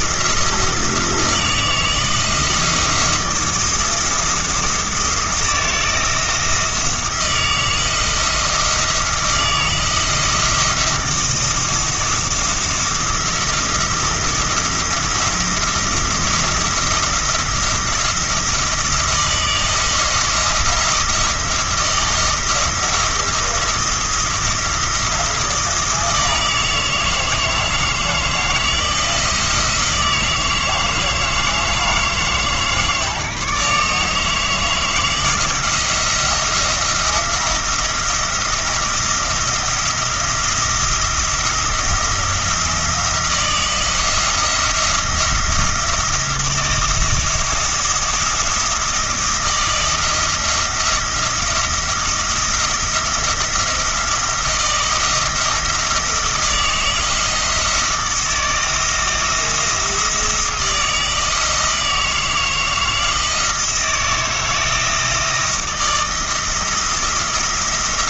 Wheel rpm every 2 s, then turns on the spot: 170, 160, 170, 160, 160, 170, 170, 170, 170, 170, 170, 170, 170, 160, 160, 160, 150, 160, 170, 170, 170, 170, 170, 170, 170, 170, 170, 160, 160, 160, 160, 160, 160, 170.
none